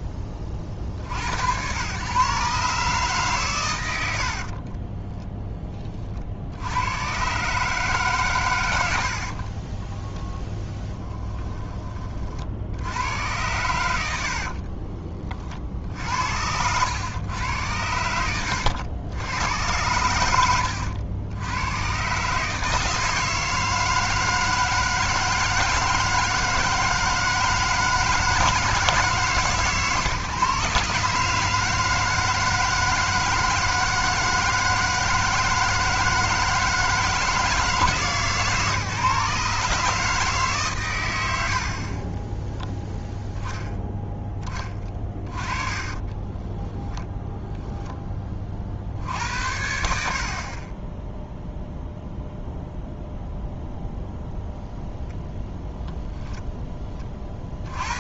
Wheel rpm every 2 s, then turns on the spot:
40, 140, 40, 100, 100, 10, 80, 40, 90, 80, 80, 160, 160, 160, 160, 140, 160, 160, 160, 150, 120, 0, 20, 10, 60, 20, 0, 0, 20.
4-6 8-12 14-16 44-48 50-52